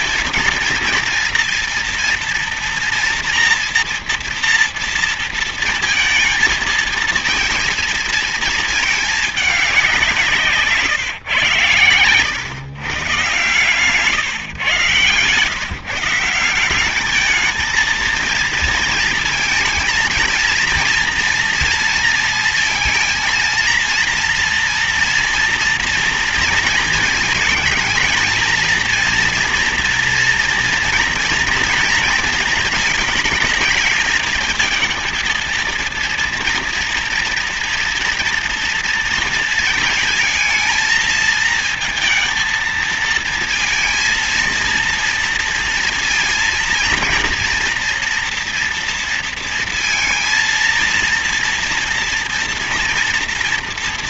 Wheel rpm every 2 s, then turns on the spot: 230, 230, 230, 230, 230, 160, 140, 150, 170, 220, 230, 230, 230, 230, 230, 240, 230, 220, 230, 240, 230, 230, 230, 230, 230, 230, 230.
none